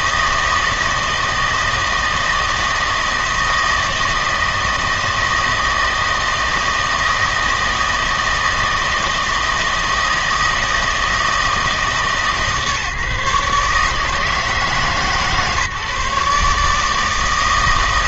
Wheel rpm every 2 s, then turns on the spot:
160, 160, 160, 160, 160, 160, 150, 150, 150.
none